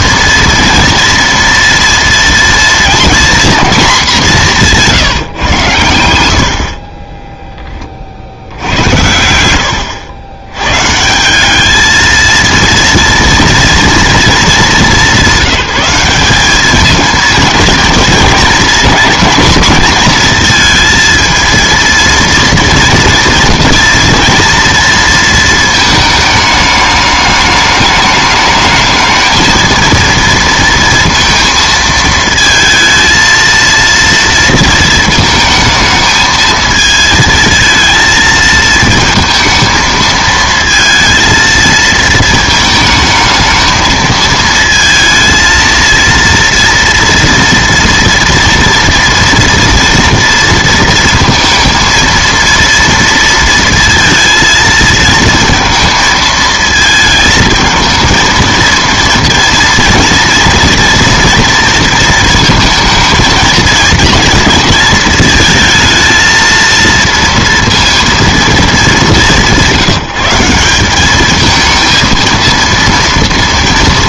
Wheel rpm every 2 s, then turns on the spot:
230, 240, 180, 40, 80, 130, 230, 200, 210, 230, 230, 230, 230, 210, 220, 230, 230, 230, 220, 220, 220, 220, 220, 240, 230, 230, 230, 230, 220, 230, 230, 230, 220, 230, 200, 180, 230.
6-8